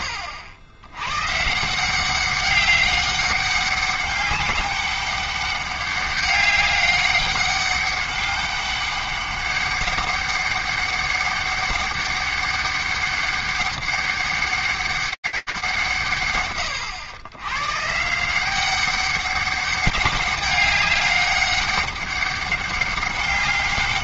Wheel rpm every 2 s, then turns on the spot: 60, 180, 200, 200, 200, 200, 200, 200, 160, 160, 200, 200.
none